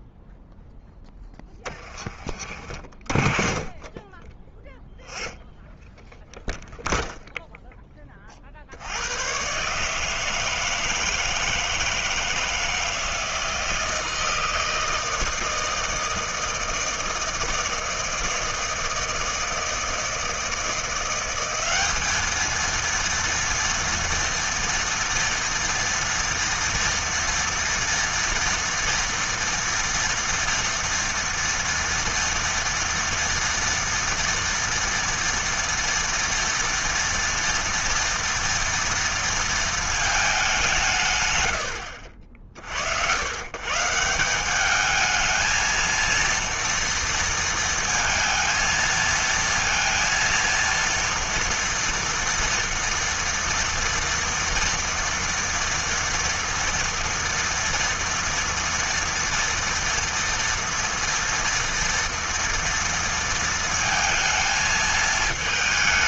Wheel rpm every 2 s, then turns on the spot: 0, 30, 10, 0, 30, 160, 160, 160, 160, 160, 170, 210, 230, 230, 230, 230, 230, 230, 230, 240, 220, 70, 170, 230, 220, 230, 240, 230, 230, 230, 230, 230, 220.
none